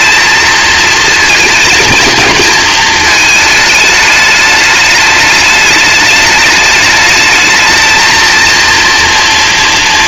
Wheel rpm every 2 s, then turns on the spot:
220, 220, 210, 210, 230.
none